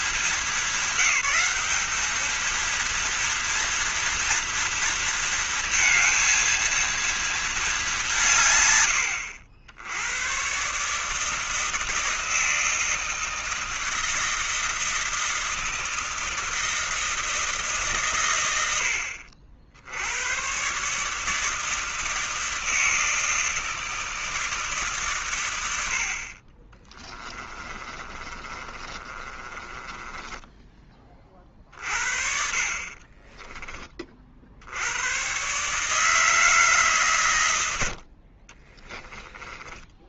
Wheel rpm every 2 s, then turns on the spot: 220, 230, 230, 230, 120, 140, 160, 160, 160, 70, 140, 160, 140, 20, 30, 20, 40, 90, 140, 20.
26-30 38-40